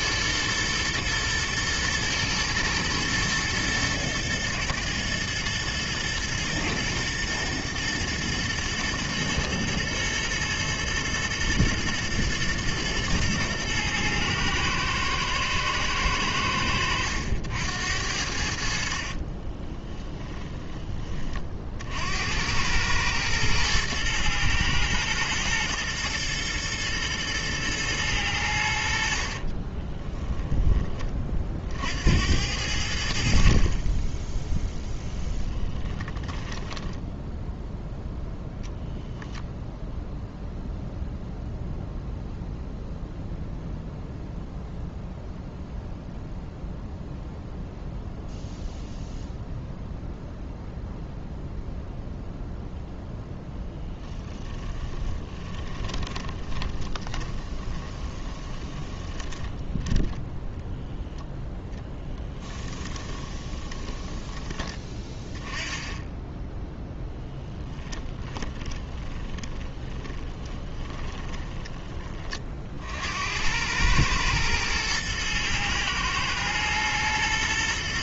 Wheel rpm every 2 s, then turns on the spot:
120, 120, 110, 120, 110, 120, 110, 110, 90, 40, 20, 100, 110, 120, 80, 20, 80, 10, 10, 0, 0, 0, 0, 0, 0, 0, 0, 20, 20, 20, 10, 20, 20, 10, 20, 20, 70, 110, 120.
18-20 36-38 54-60 62-64 66-72